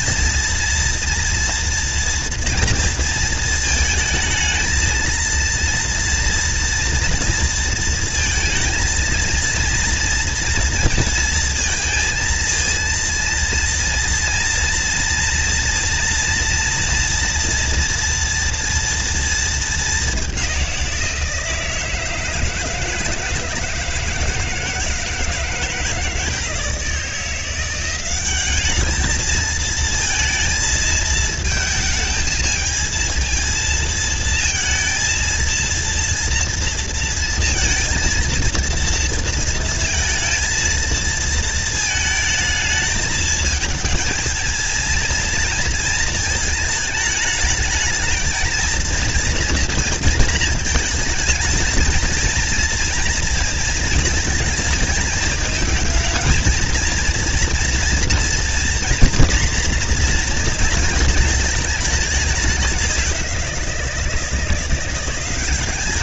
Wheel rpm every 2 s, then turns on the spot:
230, 240, 220, 230, 230, 230, 230, 230, 230, 240, 200, 160, 160, 160, 190, 230, 220, 230, 230, 230, 230, 220, 220, 220, 230, 220, 230, 220, 230, 230, 240, 200, 170.
none